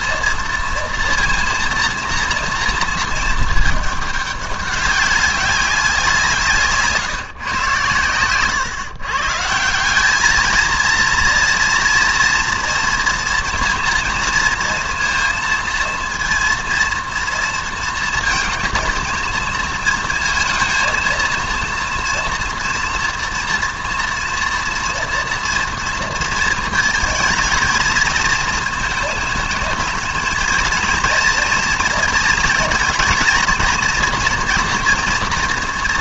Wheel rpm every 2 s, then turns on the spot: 230, 230, 200, 150, 130, 220, 240, 230, 230, 230, 220, 240, 240, 230, 230, 230, 220, 240.
none